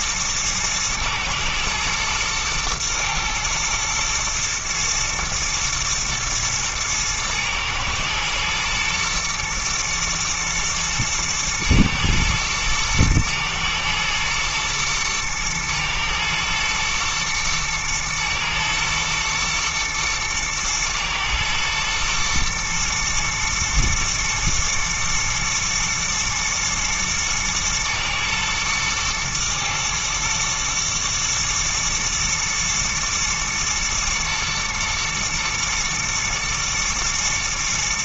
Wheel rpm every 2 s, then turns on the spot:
110, 110, 110, 110, 120, 110, 110, 110, 110, 120, 110, 110, 110, 110, 110, 110, 120, 120, 120.
none